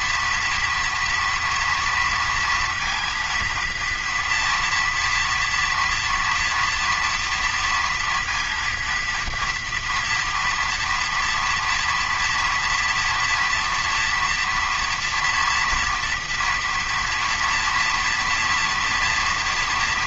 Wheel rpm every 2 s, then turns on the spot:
230, 230, 230, 230, 230, 230, 240, 230, 230, 230.
none